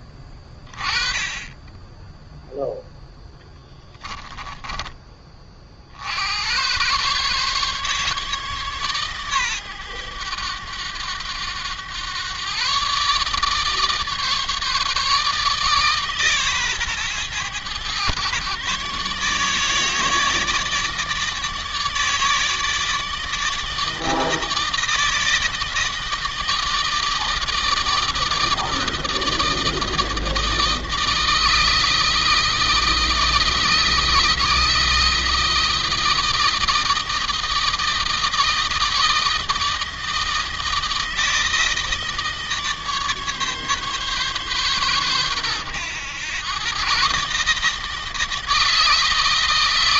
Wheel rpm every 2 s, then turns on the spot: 20, 0, 30, 130, 130, 100, 140, 150, 120, 140, 150, 160, 160, 160, 160, 160, 160, 160, 160, 160, 160, 150, 120, 130, 160.
none